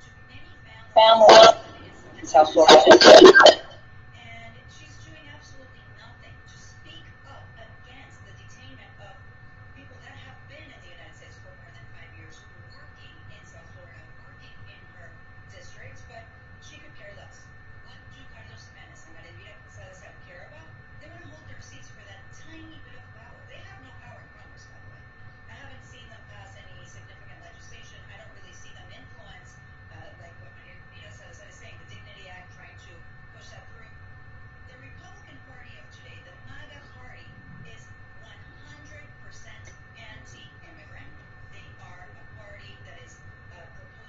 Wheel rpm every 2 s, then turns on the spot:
0, 0, 0, 0, 0, 0, 0, 0, 0, 0, 0, 0, 0, 0, 0, 0, 0, 0, 0, 0, 0, 0.
none